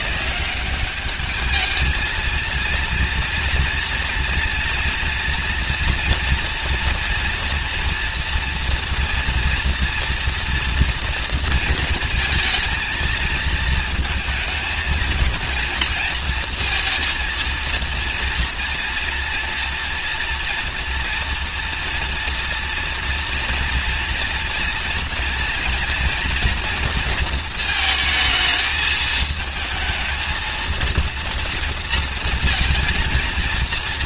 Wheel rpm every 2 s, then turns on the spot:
200, 230, 230, 230, 230, 230, 220, 220, 230, 230, 240, 230, 230, 230, 220, 230, 230.
none